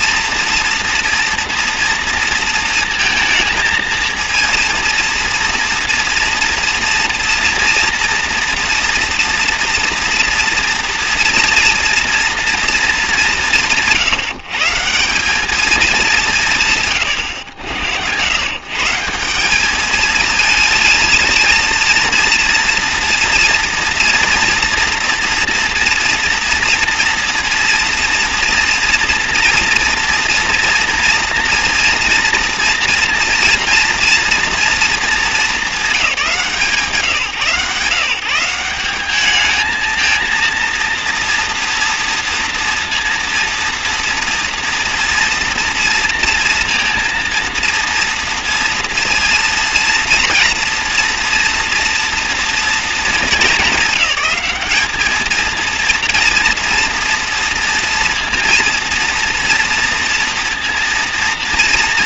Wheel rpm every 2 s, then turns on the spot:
230, 220, 230, 230, 230, 230, 220, 170, 120, 140, 230, 230, 230, 230, 230, 230, 230, 230, 170, 190, 230, 230, 230, 230, 230, 230, 220, 210, 230, 230, 230.
none